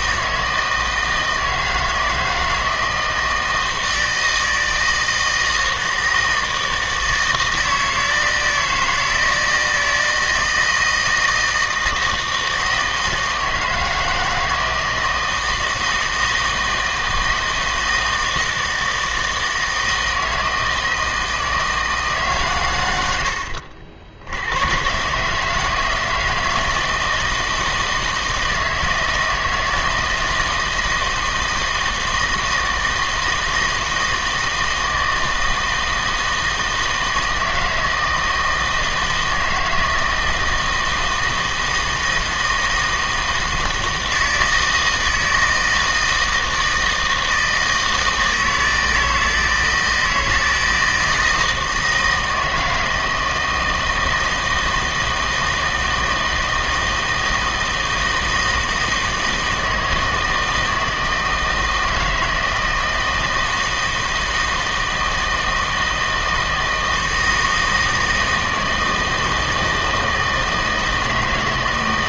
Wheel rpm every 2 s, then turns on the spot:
160, 160, 160, 160, 160, 160, 160, 160, 160, 160, 160, 100, 120, 160, 160, 160, 160, 160, 160, 160, 160, 160, 160, 160, 160, 160, 160, 160, 160, 160, 160, 160, 160, 160, 160, 160.
none